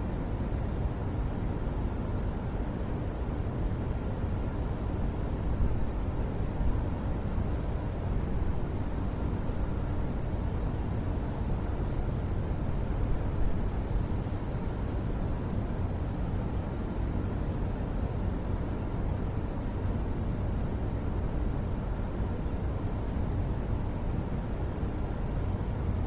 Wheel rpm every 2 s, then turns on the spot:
0, 0, 0, 0, 0, 0, 0, 0, 0, 0, 0, 0, 0.
none